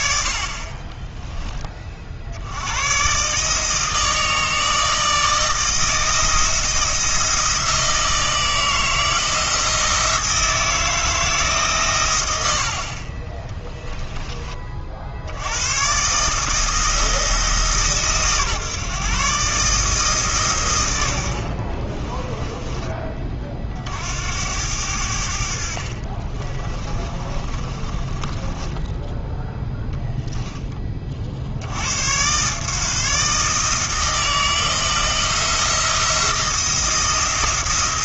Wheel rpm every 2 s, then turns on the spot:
30, 110, 160, 170, 160, 160, 50, 40, 160, 140, 110, 20, 90, 30, 10, 20, 150, 170, 170.
26-30